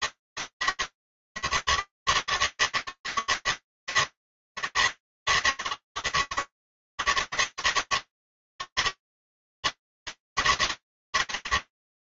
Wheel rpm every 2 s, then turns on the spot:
160, 150, 160, 150, 160, 160.
none